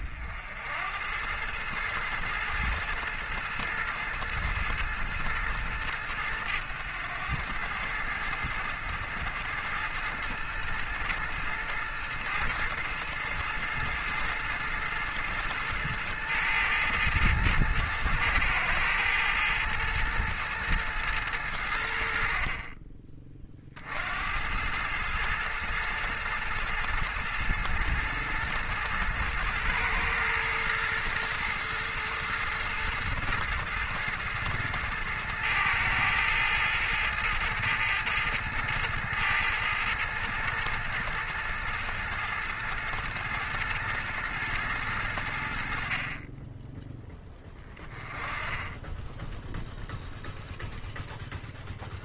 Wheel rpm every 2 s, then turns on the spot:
80, 110, 110, 100, 110, 110, 110, 110, 110, 110, 110, 30, 110, 110, 110, 110, 110, 110, 110, 110, 110, 110, 100, 10, 10, 0.
none